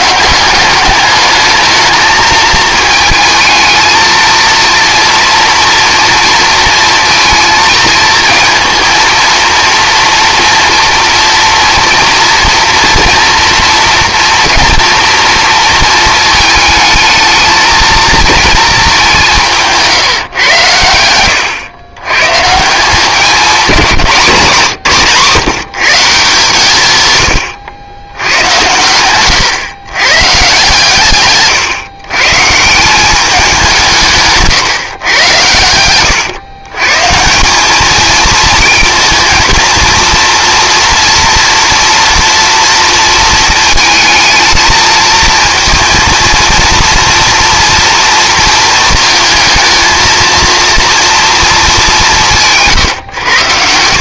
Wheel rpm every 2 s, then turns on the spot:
190, 220, 230, 230, 230, 230, 230, 240, 220, 230, 120, 140, 170, 130, 110, 140, 150, 150, 120, 220, 230, 230, 220, 230, 230, 230, 150.
28-30 34-36